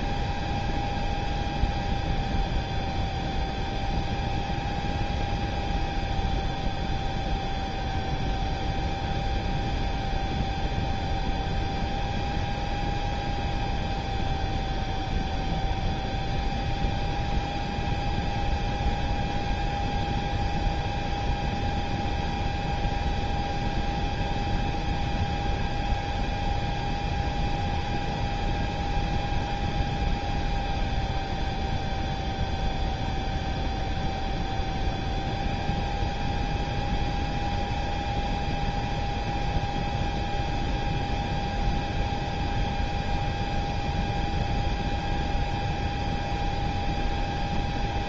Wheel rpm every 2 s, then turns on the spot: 0, 0, 0, 0, 0, 0, 0, 0, 0, 0, 0, 0, 0, 0, 0, 0, 0, 0, 0, 0, 0, 0, 0, 0.
none